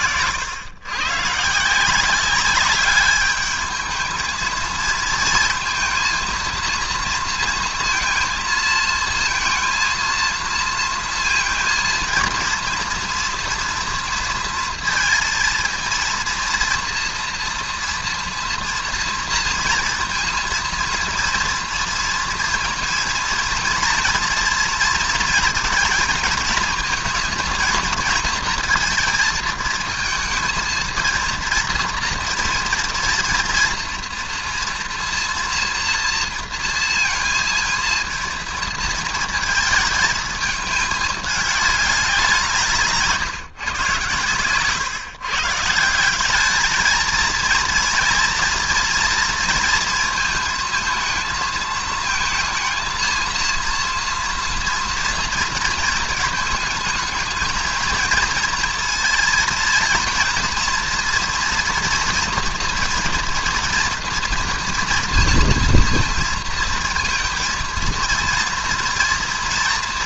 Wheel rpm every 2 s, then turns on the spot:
110, 200, 230, 230, 220, 230, 230, 230, 230, 230, 230, 230, 230, 220, 230, 230, 230, 230, 230, 230, 210, 160, 130, 220, 230, 220, 230, 230, 220, 230, 230, 230, 230, 230, 230.
44-46